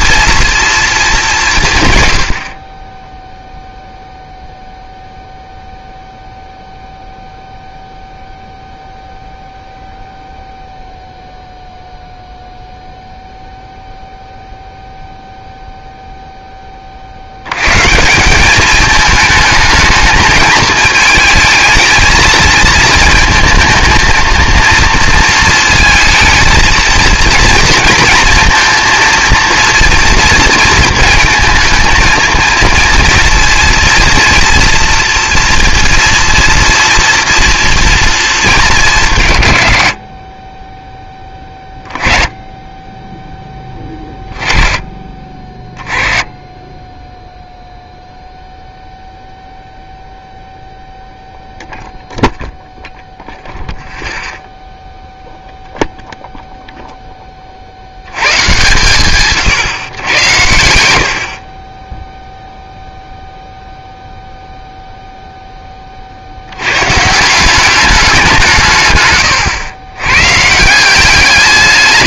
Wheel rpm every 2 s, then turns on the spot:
230, 50, 0, 0, 0, 0, 0, 0, 10, 200, 220, 220, 230, 220, 230, 230, 230, 240, 230, 200, 20, 10, 20, 10, 0, 0, 0, 0, 0, 120, 90, 0, 0, 100, 150, 160.
none